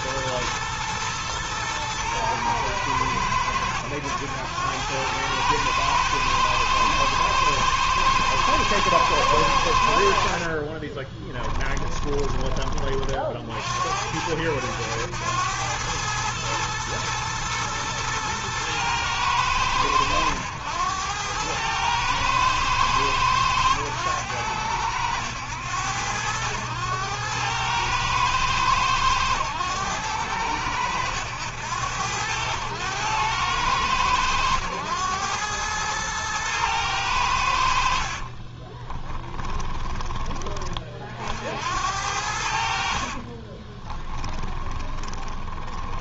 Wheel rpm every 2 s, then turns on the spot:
110, 110, 90, 110, 110, 50, 30, 90, 110, 110, 100, 110, 100, 100, 110, 100, 100, 100, 110, 40, 20, 70, 20.
10-12 38-40 44-46